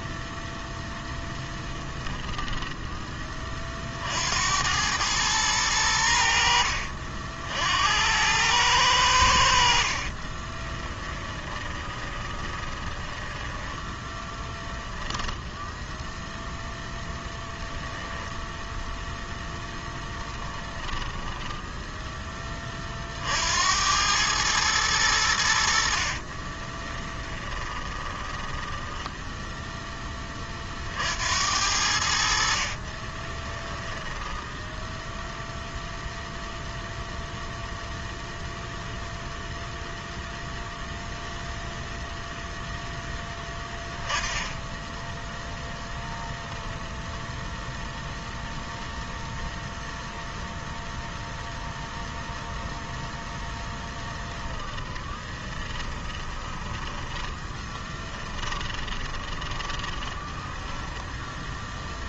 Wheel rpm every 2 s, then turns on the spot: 10, 20, 100, 60, 90, 10, 10, 10, 0, 0, 10, 40, 100, 20, 10, 60, 20, 0, 0, 0, 0, 0, 10, 0, 0, 0, 0, 10, 10, 20, 10.
10-16 20-22 26-30 32-34 54-62